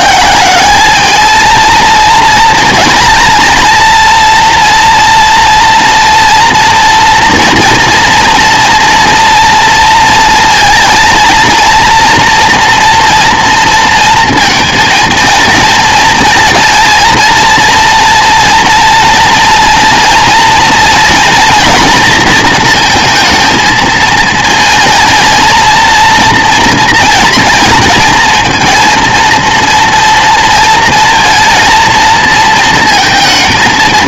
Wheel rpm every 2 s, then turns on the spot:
200, 230, 230, 230, 230, 230, 240, 230, 220, 230, 230, 220, 220, 230, 230, 230, 230.
none